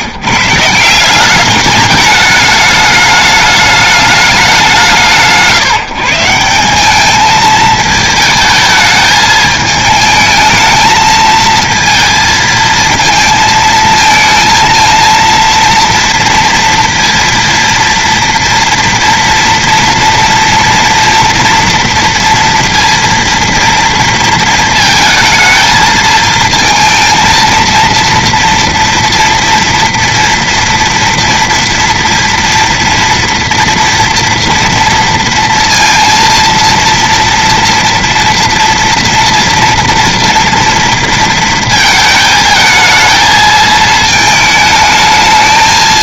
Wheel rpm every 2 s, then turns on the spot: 150, 210, 180, 180, 220, 220, 220, 230, 230, 230, 230, 230, 220, 230, 230, 230, 230, 230, 230, 230, 230, 220, 220.
none